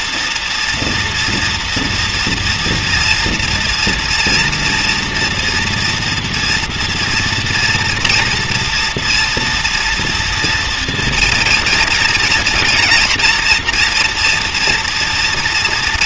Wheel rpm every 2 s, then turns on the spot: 240, 230, 240, 240, 230, 230, 230, 240.
none